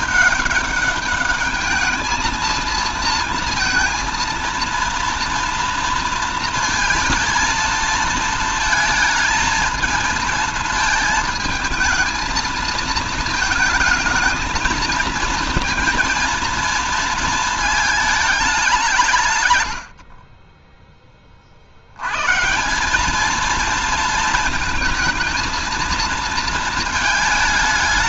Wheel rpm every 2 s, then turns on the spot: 200, 230, 230, 230, 220, 220, 220, 220, 230, 160, 10, 180, 230, 220.
none